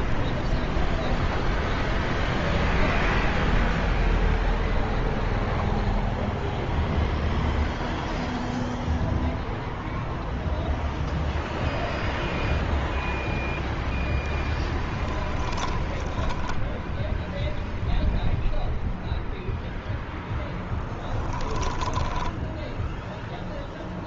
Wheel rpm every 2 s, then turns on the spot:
0, 0, 0, 0, 0, 0, 0, 20, 10, 0, 10, 0.
14-16 20-22